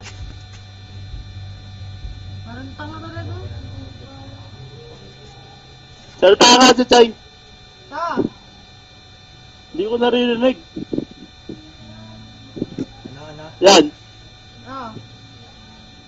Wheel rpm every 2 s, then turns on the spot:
0, 0, 0, 0, 0, 0, 0, 0.
none